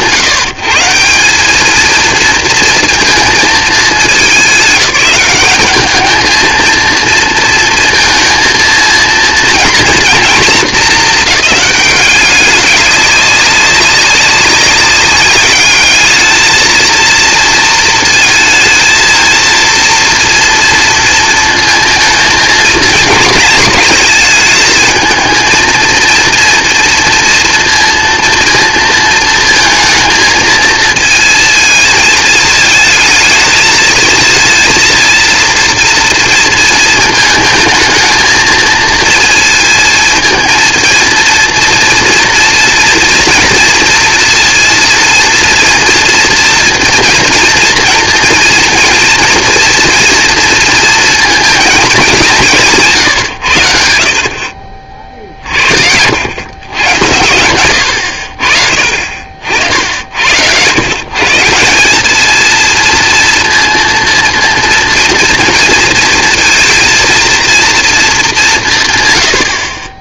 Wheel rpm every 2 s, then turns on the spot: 160, 230, 190, 230, 230, 220, 190, 190, 220, 230, 230, 220, 220, 230, 230, 220, 220, 230, 230, 230, 230, 230, 230, 240, 230, 230, 170, 50, 100, 50, 120, 230, 230, 230, 200.
none